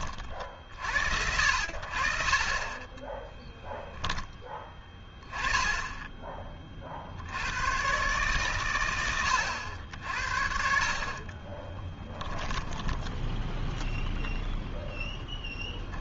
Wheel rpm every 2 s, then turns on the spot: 60, 0, 10, 130, 80, 20, 0, 10.
10-12